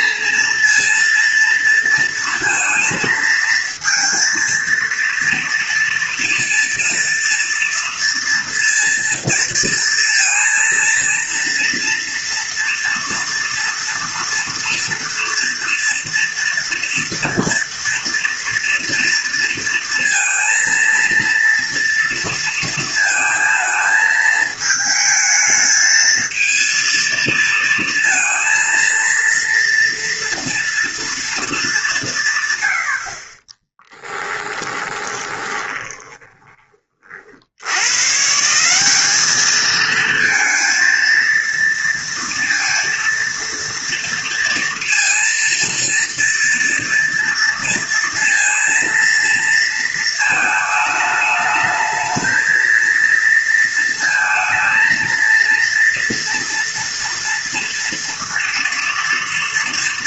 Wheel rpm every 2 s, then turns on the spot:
230, 230, 230, 230, 230, 230, 230, 230, 230, 230, 230, 230, 220, 230, 230, 230, 50, 20, 40, 190, 230, 230, 230, 230, 230, 210, 230, 230, 230, 230.
34-36